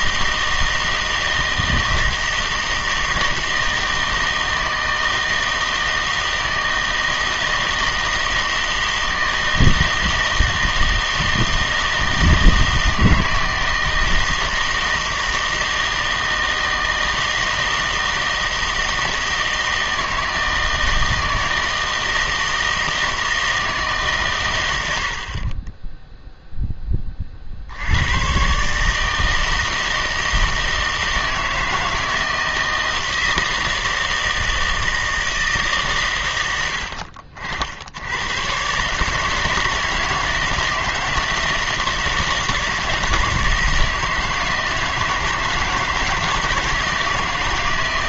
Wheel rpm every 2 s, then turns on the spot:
160, 160, 160, 160, 160, 160, 160, 160, 160, 160, 160, 160, 110, 10, 140, 160, 160, 160, 100, 120, 160, 150, 170, 160.
none